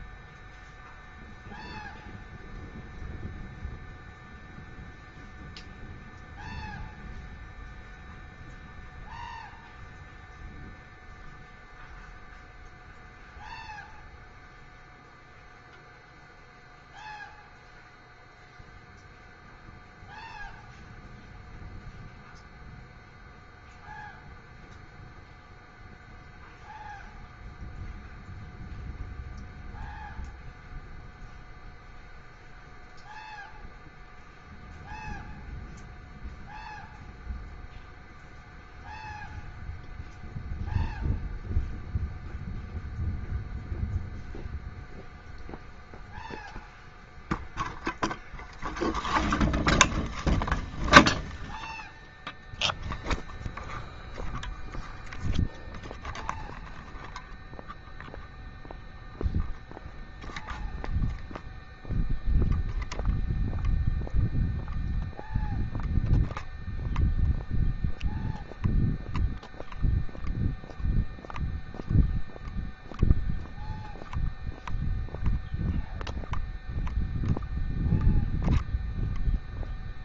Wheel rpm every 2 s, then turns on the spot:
0, 0, 0, 0, 0, 0, 0, 0, 0, 0, 0, 0, 0, 0, 0, 0, 0, 0, 0, 0, 0, 0, 0, 0, 10, 10, 0, 0, 0, 0, 0, 0, 0, 0, 0, 0, 0, 0, 0, 0.
none